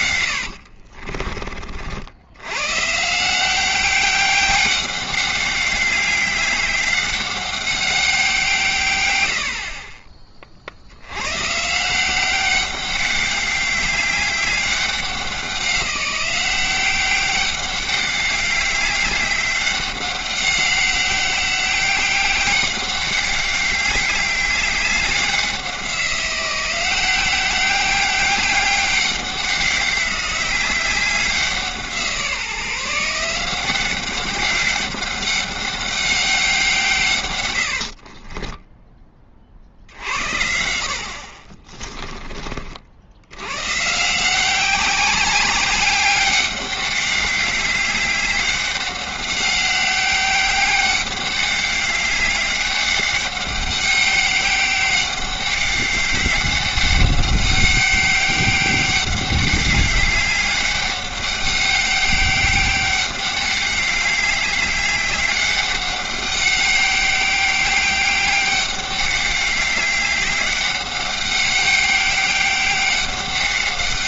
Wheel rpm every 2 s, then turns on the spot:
70, 110, 200, 190, 150, 60, 190, 200, 190, 200, 190, 190, 200, 180, 200, 190, 170, 200, 160, 10, 60, 50, 190, 200, 190, 200, 190, 200, 200, 200, 190, 200, 200, 200, 200, 200, 200.
0-2